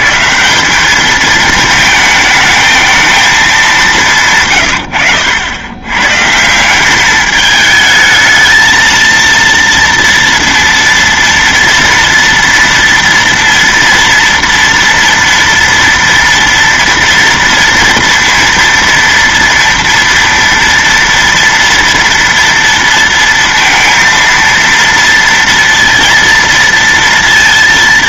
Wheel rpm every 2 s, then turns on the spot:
180, 220, 120, 180, 220, 230, 230, 230, 240, 230, 230, 230, 230, 230.
none